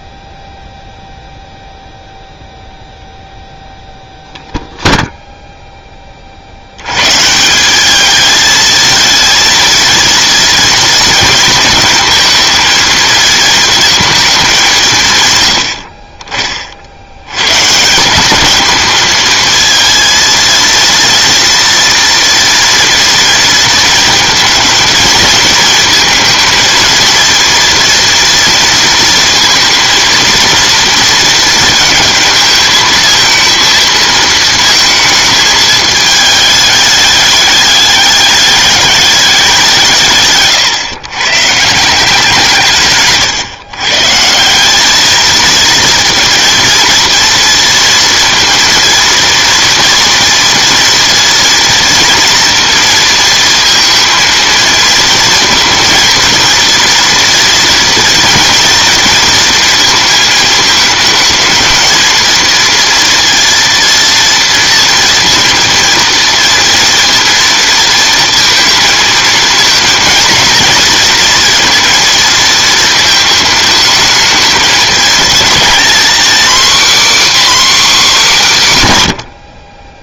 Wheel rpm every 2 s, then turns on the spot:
0, 0, 0, 70, 220, 230, 230, 200, 40, 210, 230, 230, 220, 230, 230, 230, 220, 230, 210, 210, 130, 150, 190, 230, 230, 230, 230, 230, 230, 230, 220, 230, 230, 230, 230, 230, 220, 220, 260, 190.
none